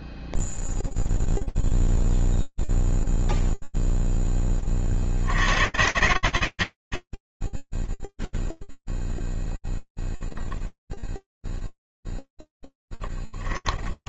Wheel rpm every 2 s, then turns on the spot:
0, 0, 0, 100, 0, 0, 0.
none